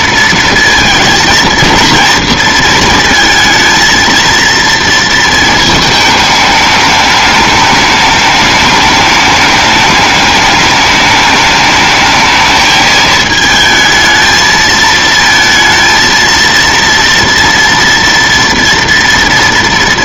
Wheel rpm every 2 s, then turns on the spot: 230, 230, 230, 210, 210, 210, 220, 220, 230, 230.
none